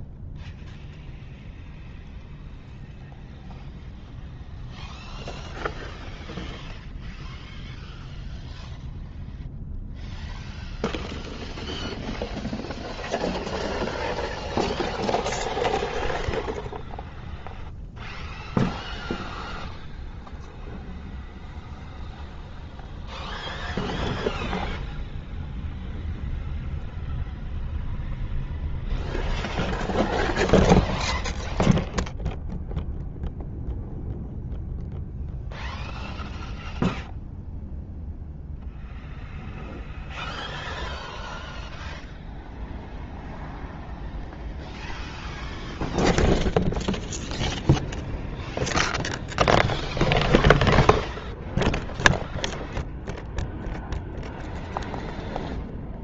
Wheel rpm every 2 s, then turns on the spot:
0, 0, 0, 0, 0, 0, 0, 0, 0, 0, 0, 0, 0, 0, 0, 0, 0, 0, 0, 0, 0, 0, 0, 0, 0, 0, 0, 0.
none